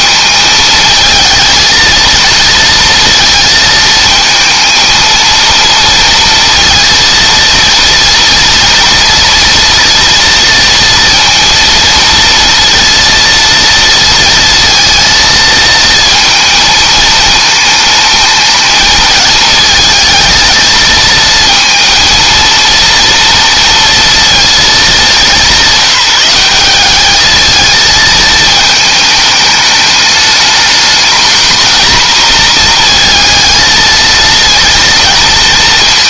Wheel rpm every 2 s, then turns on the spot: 220, 230, 230, 230, 230, 230, 230, 230, 220, 220, 220, 230, 210, 200, 220, 220, 230, 230.
none